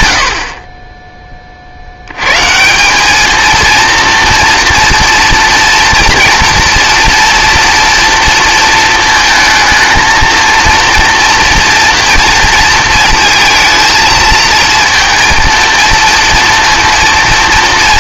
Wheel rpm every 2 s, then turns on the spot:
50, 160, 230, 230, 230, 230, 230, 230, 230.
none